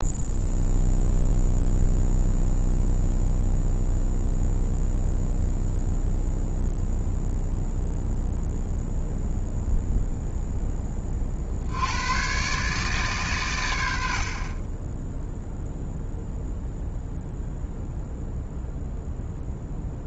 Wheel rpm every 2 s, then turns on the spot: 0, 0, 0, 0, 0, 20, 140, 20, 0, 0.
none